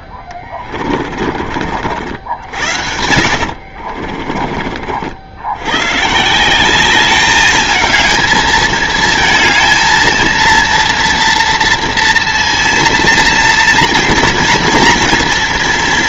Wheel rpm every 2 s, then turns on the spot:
40, 80, 50, 180, 220, 230, 240, 230.
0-4